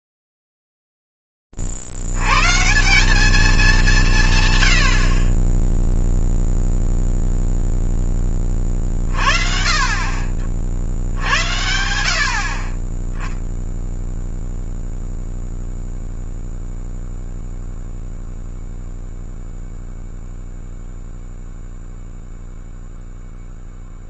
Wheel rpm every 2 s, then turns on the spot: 10, 70, 190, 10, 10, 40, 60, 0, 0, 0, 0, 0.
none